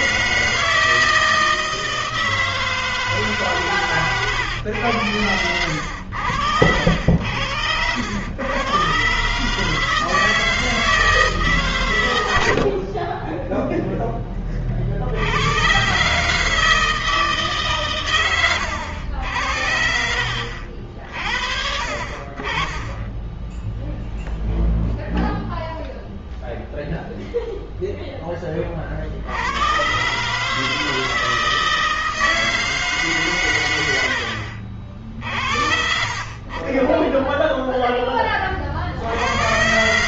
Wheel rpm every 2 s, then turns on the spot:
160, 160, 110, 80, 100, 160, 100, 20, 150, 100, 50, 40, 0, 0, 20, 150, 160, 70, 30, 20.
34-36